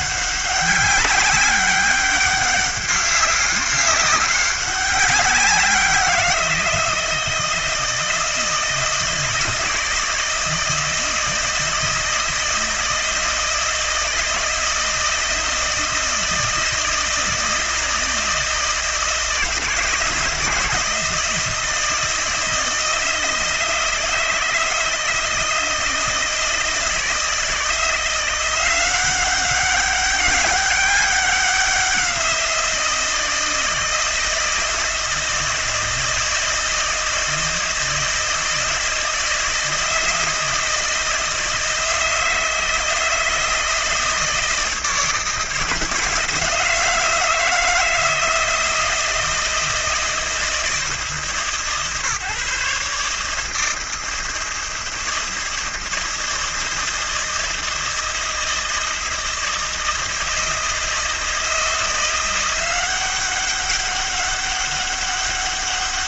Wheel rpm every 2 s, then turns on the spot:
200, 200, 200, 170, 160, 160, 160, 160, 160, 160, 160, 160, 160, 160, 180, 200, 170, 160, 160, 160, 160, 160, 160, 160, 160, 160, 140, 160, 160, 160, 160, 180, 200.
none